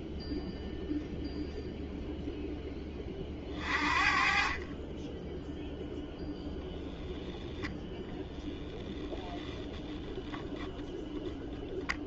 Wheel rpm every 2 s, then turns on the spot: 0, 10, 40, 0, 0, 0.
none